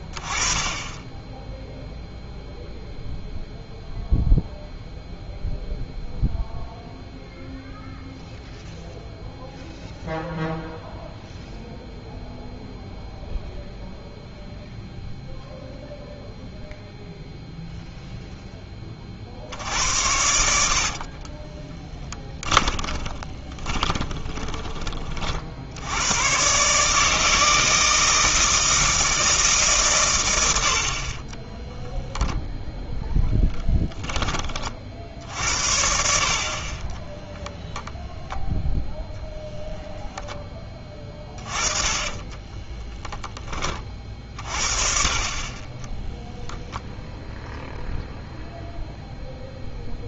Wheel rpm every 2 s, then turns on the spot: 20, 0, 0, 0, 0, 0, 0, 0, 0, 20, 60, 20, 20, 150, 160, 60, 0, 40, 30, 0, 20, 10, 40, 0, 0.
22-24 42-44